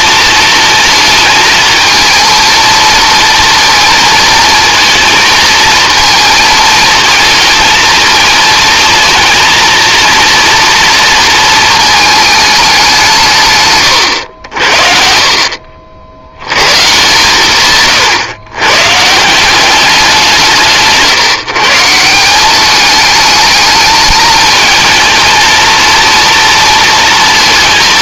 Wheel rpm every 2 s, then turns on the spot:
230, 230, 230, 220, 230, 230, 200, 60, 120, 130, 160, 210, 230, 230.
none